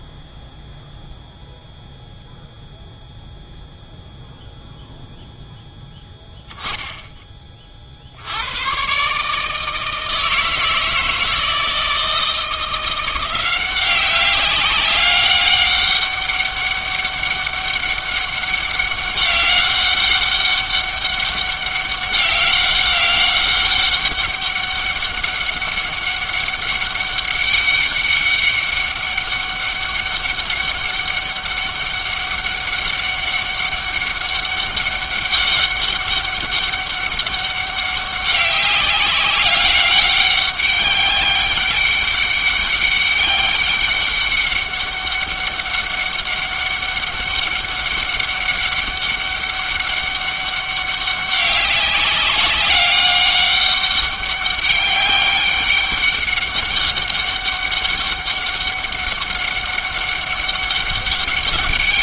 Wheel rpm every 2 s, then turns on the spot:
0, 0, 0, 10, 70, 160, 160, 190, 200, 200, 200, 200, 200, 200, 200, 200, 200, 200, 200, 190, 200, 200, 200, 200, 200, 200, 200, 200, 200, 200, 200.
none